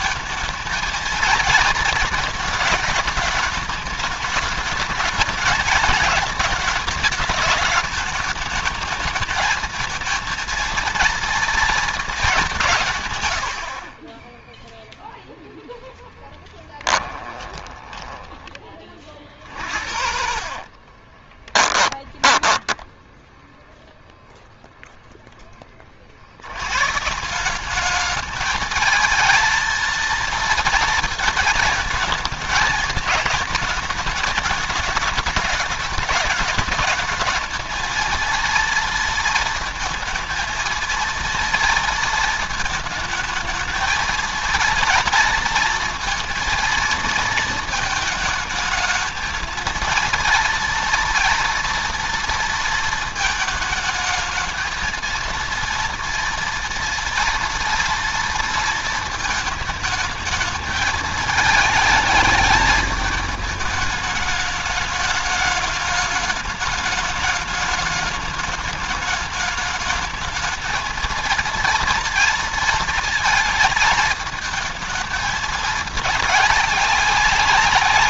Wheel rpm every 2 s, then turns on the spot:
230, 210, 210, 210, 220, 230, 140, 0, 30, 40, 30, 10, 0, 130, 220, 230, 220, 210, 210, 230, 230, 220, 230, 230, 220, 230, 230, 230, 230, 230, 220, 210, 210, 210, 210, 230, 230, 220, 200.
16-18 20-24